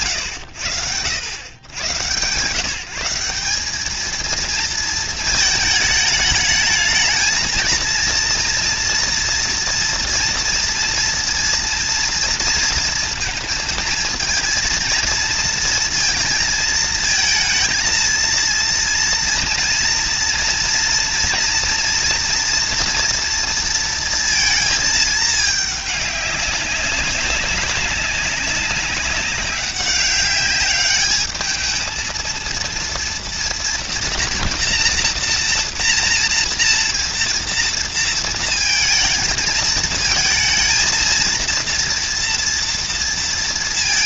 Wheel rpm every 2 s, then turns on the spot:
150, 230, 220, 230, 230, 230, 230, 230, 230, 230, 240, 220, 200, 200, 210, 230, 230, 230, 220, 220, 230, 140.
none